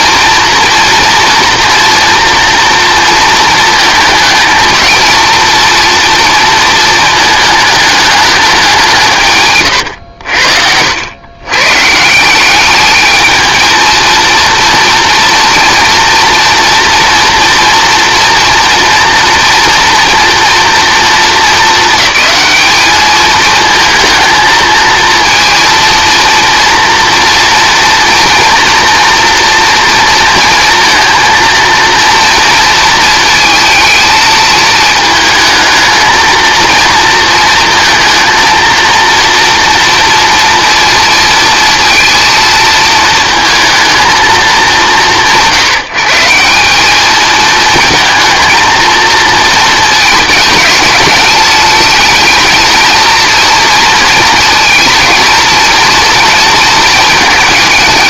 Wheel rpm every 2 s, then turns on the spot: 240, 230, 230, 230, 190, 80, 210, 230, 240, 230, 230, 210, 230, 230, 240, 230, 230, 220, 230, 230, 230, 220, 170, 200, 220, 210, 230, 230, 220.
none